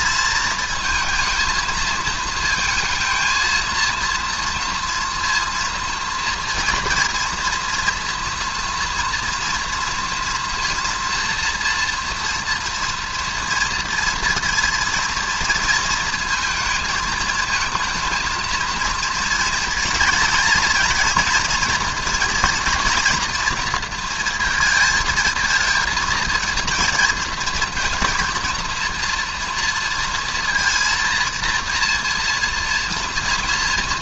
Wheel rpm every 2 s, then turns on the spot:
230, 220, 230, 240, 240, 230, 230, 230, 220, 230, 230, 240, 230, 220, 230, 230, 230.
none